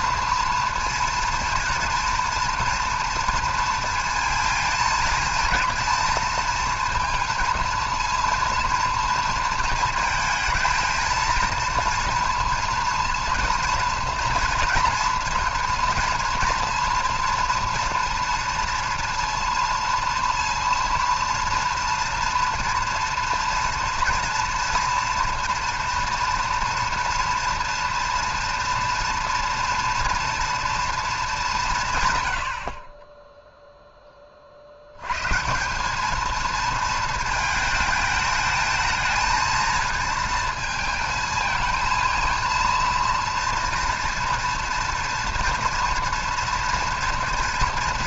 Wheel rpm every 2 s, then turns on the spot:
230, 230, 230, 230, 230, 220, 230, 230, 230, 230, 230, 240, 230, 230, 230, 230, 50, 60, 230, 220, 220, 230, 230, 230.
none